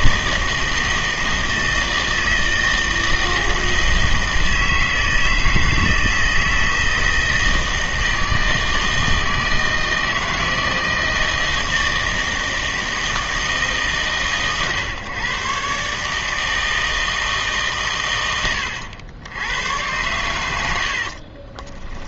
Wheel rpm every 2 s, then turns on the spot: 160, 160, 160, 160, 160, 160, 160, 130, 160, 100, 60.
none